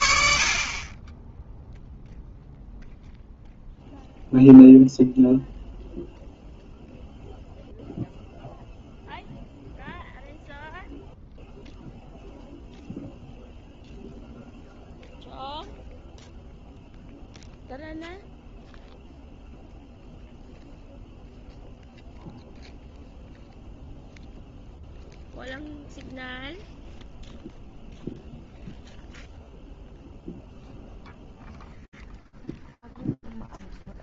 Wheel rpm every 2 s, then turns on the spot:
60, 0, 0, 0, 0, 0, 0, 0, 0, 0, 0, 0, 0, 0, 0, 0, 0.
none